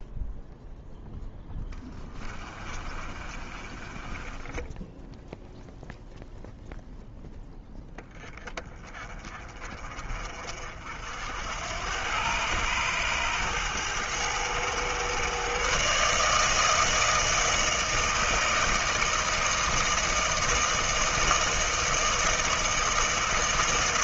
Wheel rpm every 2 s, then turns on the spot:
0, 30, 10, 0, 20, 70, 110, 120, 160, 160, 160, 160.
2-6